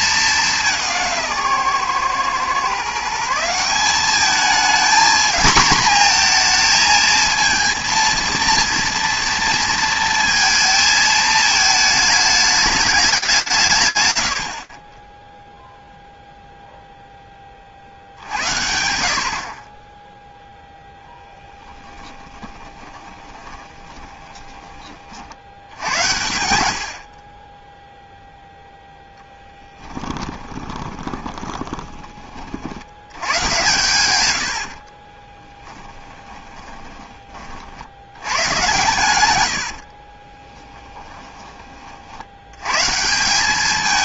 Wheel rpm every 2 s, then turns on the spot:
180, 140, 220, 230, 230, 220, 210, 50, 0, 70, 10, 20, 70, 20, 0, 20, 100, 30, 20, 110, 10, 160.
22-24 30-32 34-36 40-42